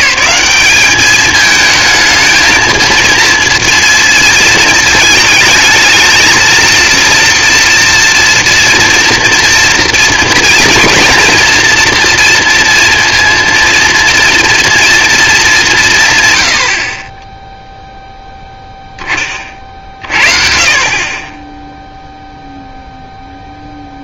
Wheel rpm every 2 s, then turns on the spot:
200, 220, 230, 230, 230, 240, 230, 230, 90, 0, 40, 0.
none